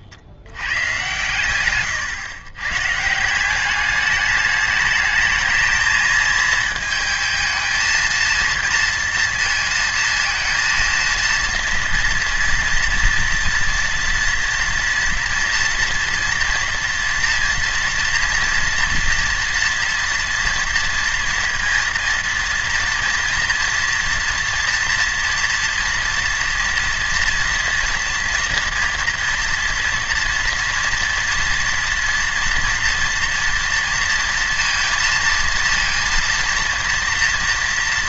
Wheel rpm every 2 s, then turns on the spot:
100, 130, 210, 220, 230, 230, 240, 230, 230, 230, 230, 230, 230, 230, 230, 230, 230, 230, 230.
none